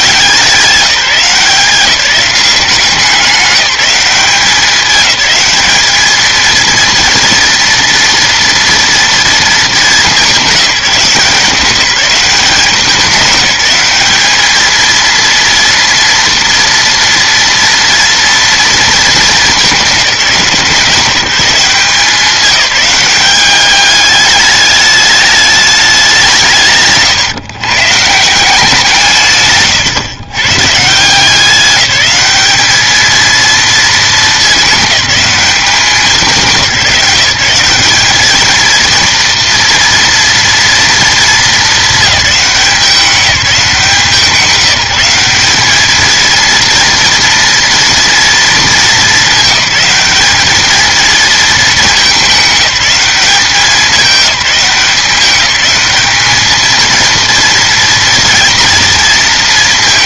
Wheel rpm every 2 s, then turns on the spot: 170, 190, 200, 230, 230, 190, 200, 220, 230, 230, 170, 190, 210, 160, 170, 130, 210, 220, 180, 220, 230, 200, 180, 230, 220, 210, 210, 200, 220, 230.
none